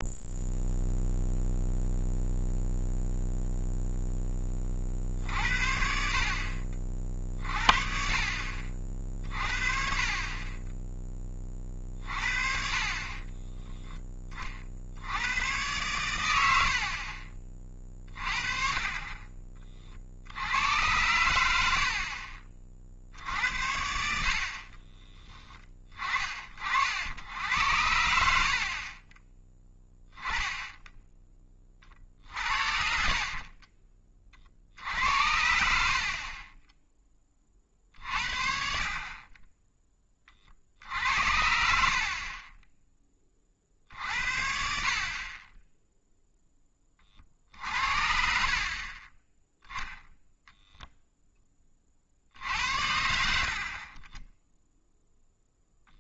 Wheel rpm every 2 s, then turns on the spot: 0, 0, 40, 50, 40, 20, 40, 50, 70, 30, 100, 60, 30, 60, 50, 10, 50, 70, 10, 50, 50, 20, 50, 20, 40, 0, 70, 0.
24-26 32-34 48-50